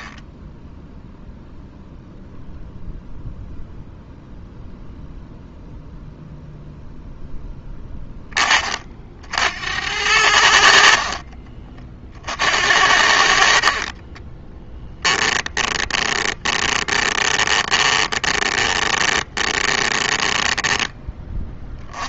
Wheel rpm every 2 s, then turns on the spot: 0, 0, 0, 0, 40, 60, 70, 10, 20, 20, 10.
10-12 14-20